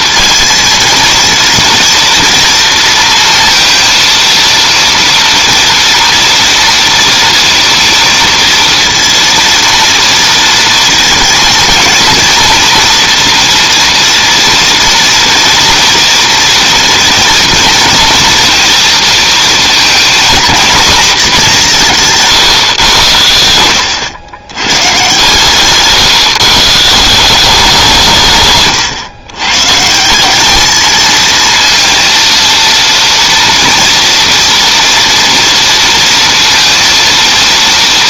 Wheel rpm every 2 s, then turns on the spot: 230, 230, 230, 230, 230, 230, 230, 230, 230, 230, 240, 120, 110, 150, 120, 210, 230, 230, 230.
none